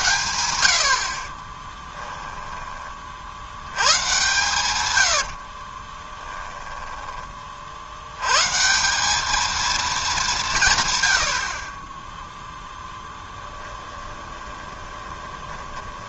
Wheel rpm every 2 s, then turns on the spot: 70, 30, 120, 10, 170, 140, 10, 20.
6-8 12-16